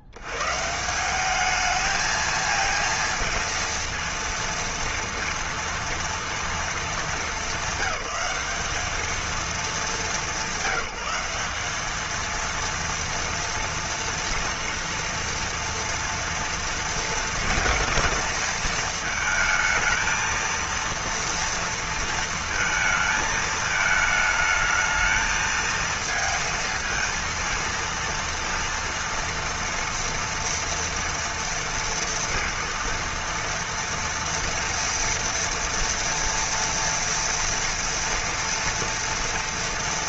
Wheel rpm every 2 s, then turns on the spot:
100, 220, 230, 230, 200, 200, 230, 230, 230, 220, 230, 230, 220, 220, 230, 230, 230, 230, 230, 230.
none